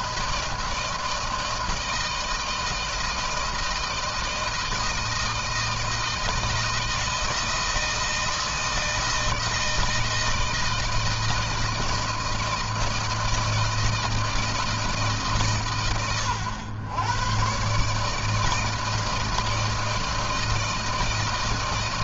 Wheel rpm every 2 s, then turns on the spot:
160, 160, 160, 160, 160, 160, 160, 160, 120, 160, 160.
none